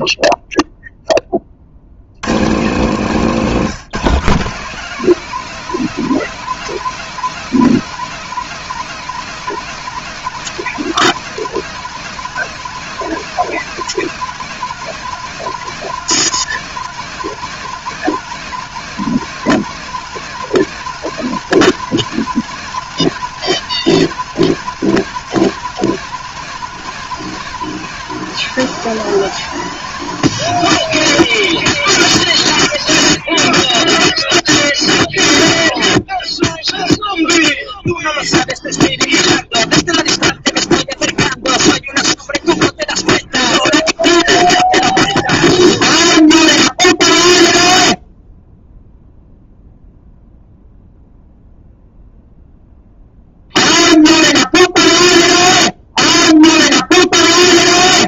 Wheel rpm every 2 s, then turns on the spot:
30, 170, 200, 230, 230, 220, 220, 220, 220, 210, 210, 210, 210, 210, 210, 210, 50, 0, 0, 0, 0, 0, 0, 0, 0, 0, 0, 0, 0.
none